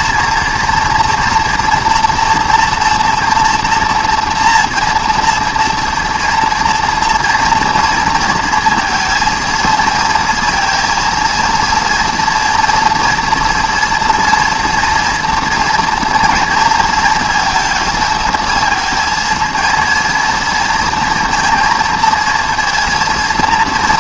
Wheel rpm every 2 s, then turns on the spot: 230, 240, 230, 240, 230, 230, 230, 240, 230, 230, 230, 230.
none